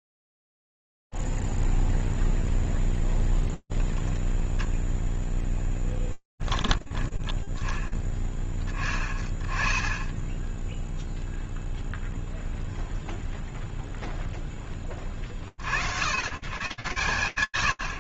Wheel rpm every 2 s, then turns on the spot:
0, 0, 0, 10, 10, 10, 0, 0, 120.
6-8